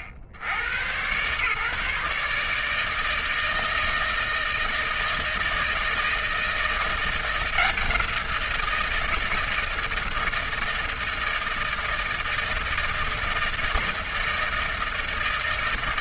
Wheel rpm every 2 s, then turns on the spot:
100, 150, 160, 170, 170, 160, 160, 160.
none